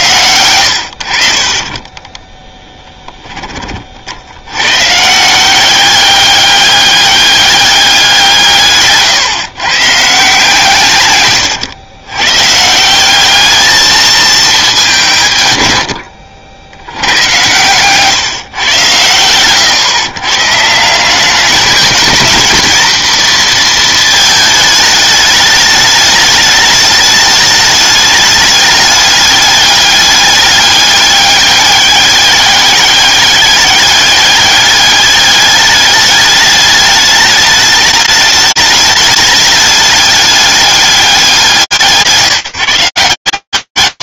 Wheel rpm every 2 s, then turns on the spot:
90, 10, 110, 200, 160, 150, 140, 200, 90, 130, 140, 230, 220, 210, 210, 200, 200, 200, 210, 210, 210, 150.
0-4